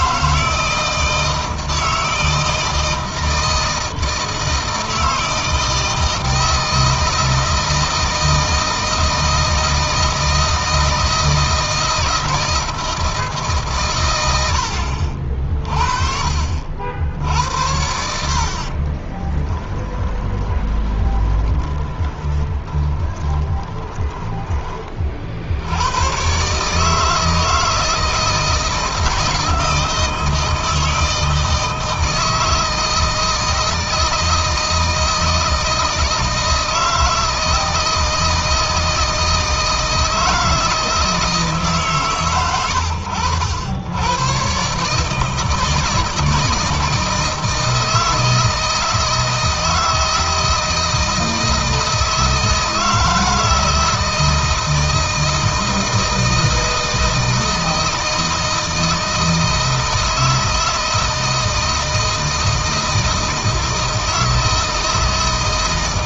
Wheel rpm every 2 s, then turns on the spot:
160, 160, 160, 160, 160, 160, 160, 70, 70, 30, 20, 20, 40, 150, 160, 160, 160, 160, 160, 160, 160, 100, 150, 160, 160, 160, 160, 160, 160, 160, 160, 160, 160.
18-24